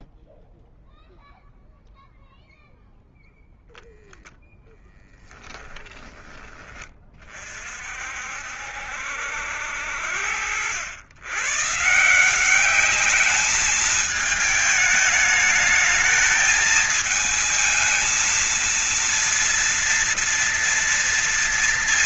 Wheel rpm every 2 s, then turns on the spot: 0, 0, 0, 20, 50, 70, 160, 220, 220, 220, 230.
none